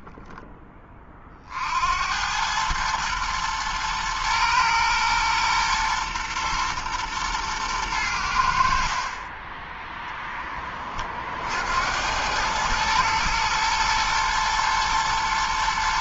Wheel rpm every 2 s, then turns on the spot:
30, 110, 120, 120, 40, 40, 110, 110.
none